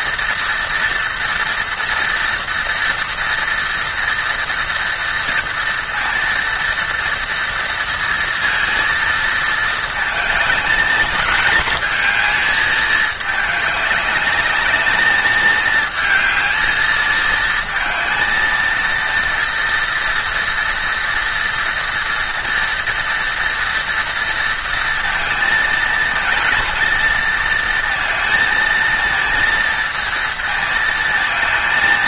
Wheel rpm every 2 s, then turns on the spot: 230, 230, 230, 230, 230, 220, 210, 210, 220, 230, 230, 230, 230, 220, 230, 220.
none